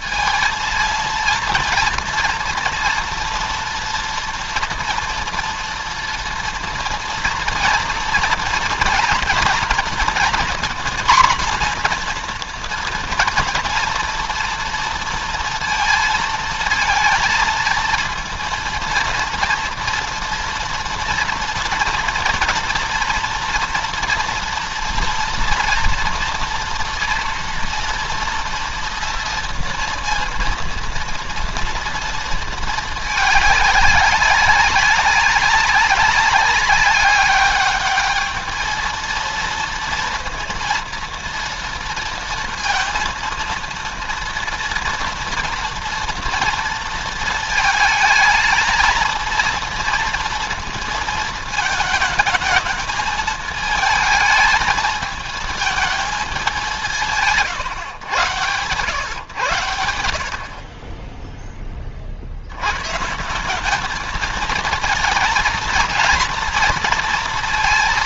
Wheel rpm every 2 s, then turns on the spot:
230, 240, 230, 230, 230, 230, 240, 230, 230, 230, 230, 230, 230, 230, 230, 230, 220, 200, 200, 220, 230, 230, 230, 230, 220, 230, 220, 220, 190, 110, 40, 90, 220, 230.
none